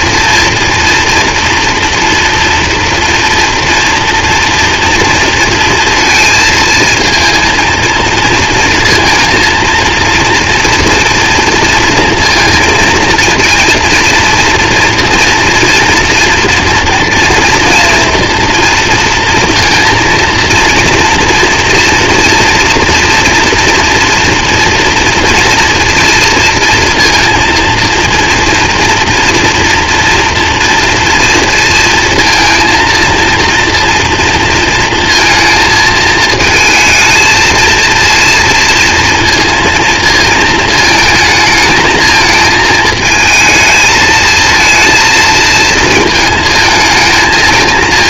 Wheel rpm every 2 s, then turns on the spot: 230, 240, 240, 230, 230, 230, 230, 230, 230, 230, 230, 230, 230, 230, 240, 240, 240, 230, 220, 230, 220, 220, 230, 220.
none